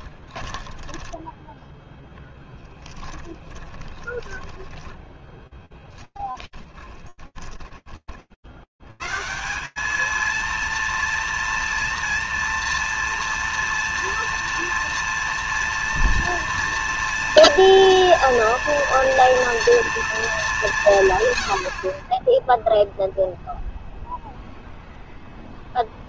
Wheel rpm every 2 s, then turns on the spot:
20, 10, 10, 20, 70, 230, 230, 230, 230, 230, 210, 0, 0.
0-8